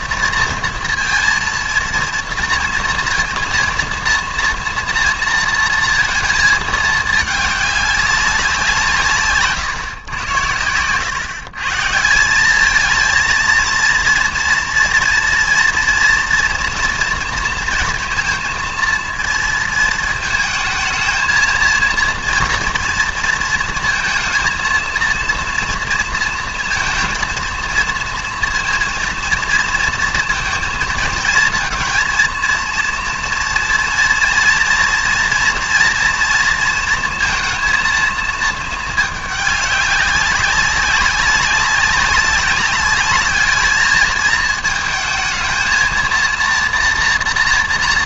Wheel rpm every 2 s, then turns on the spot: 230, 230, 240, 220, 180, 100, 200, 230, 230, 230, 220, 230, 230, 230, 230, 230, 230, 230, 230, 220, 200, 200, 220, 230.
none